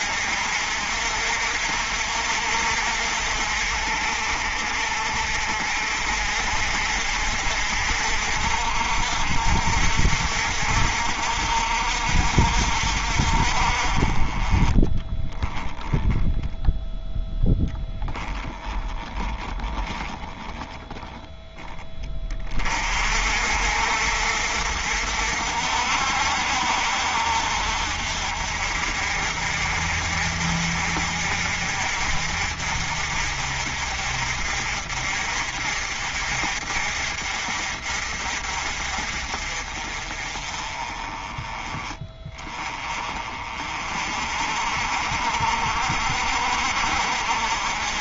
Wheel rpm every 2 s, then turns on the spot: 50, 60, 50, 50, 60, 60, 50, 20, 0, 20, 10, 40, 60, 60, 50, 50, 50, 50, 50, 50, 30, 30, 50, 50.
14-16 18-22